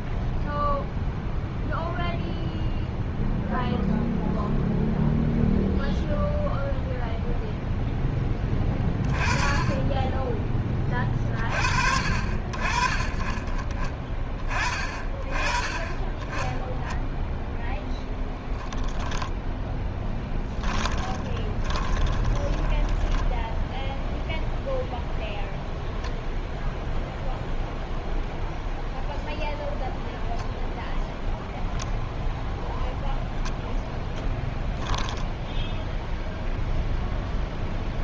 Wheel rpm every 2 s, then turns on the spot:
0, 0, 0, 0, 20, 20, 40, 30, 10, 10, 20, 20, 0, 0, 0, 0, 0, 10, 0.
20-24